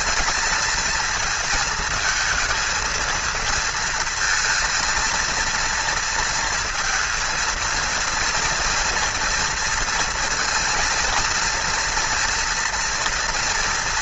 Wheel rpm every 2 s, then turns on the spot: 220, 220, 230, 230, 230, 230, 230.
none